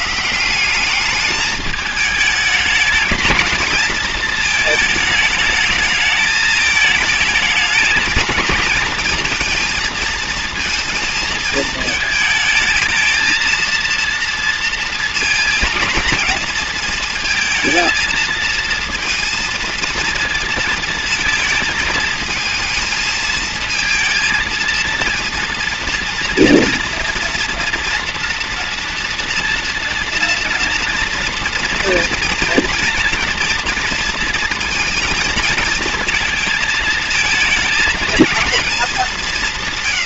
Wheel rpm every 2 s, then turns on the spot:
180, 220, 220, 220, 220, 230, 220, 230, 220, 230, 230, 220, 230, 230, 230, 230, 230, 230, 230, 220.
none